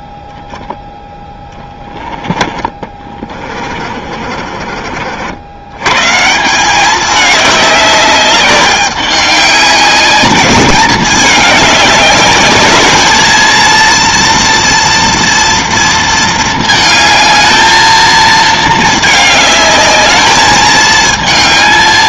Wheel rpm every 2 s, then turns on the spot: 10, 20, 40, 190, 200, 210, 210, 230, 220, 220, 220.
4-6